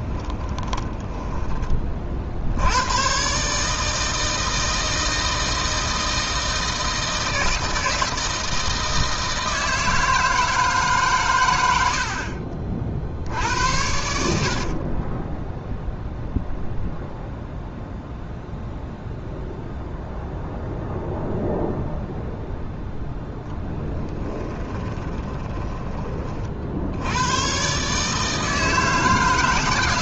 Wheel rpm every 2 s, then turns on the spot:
10, 110, 160, 160, 160, 150, 50, 40, 0, 0, 0, 0, 30, 60, 160.
0-2 14-16 24-26